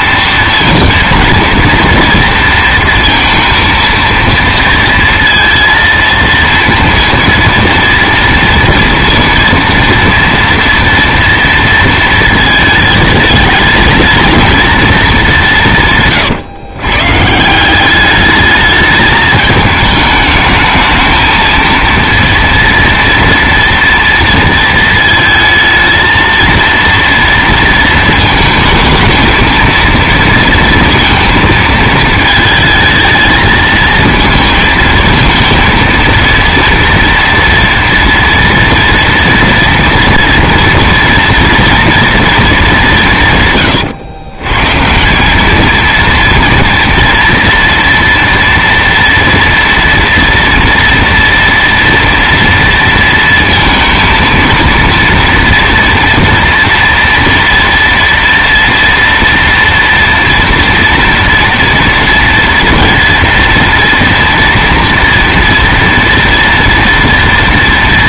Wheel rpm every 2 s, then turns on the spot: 230, 230, 230, 230, 230, 230, 220, 230, 130, 210, 220, 230, 230, 230, 220, 230, 220, 220, 230, 230, 230, 200, 150, 230, 230, 230, 230, 230, 230, 230, 230, 230, 230, 230.
none